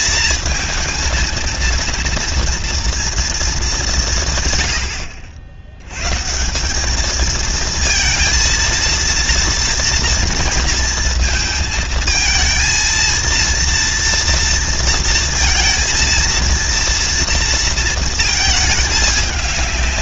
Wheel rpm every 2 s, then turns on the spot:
230, 230, 140, 160, 230, 230, 220, 230, 230, 220.
none